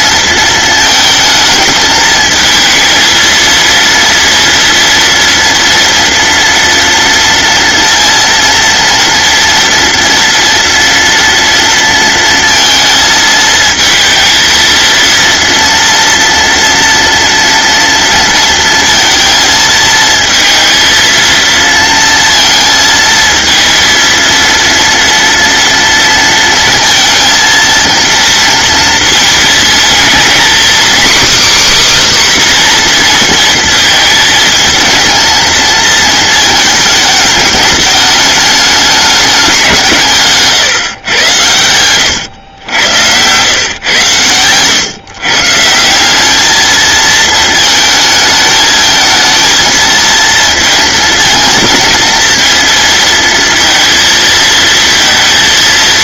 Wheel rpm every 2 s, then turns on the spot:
230, 220, 230, 230, 230, 230, 230, 220, 230, 230, 230, 230, 230, 230, 230, 230, 280, 230, 220, 210, 190, 110, 110, 150, 220, 220, 230, 230.
none